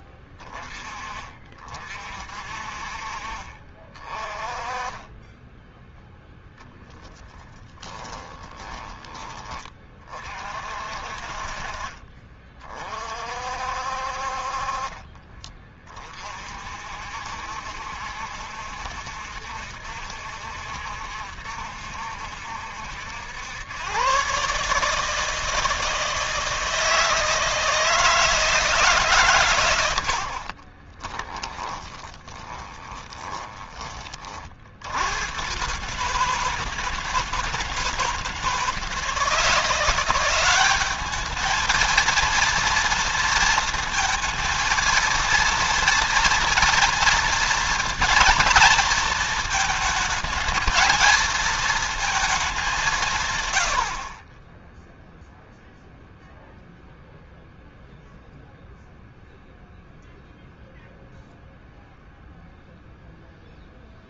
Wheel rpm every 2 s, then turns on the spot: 40, 50, 20, 10, 20, 50, 40, 40, 50, 70, 70, 80, 150, 160, 150, 30, 20, 70, 160, 160, 200, 230, 230, 230, 230, 230, 180, 10, 0, 0, 0, 0.
14-16 30-34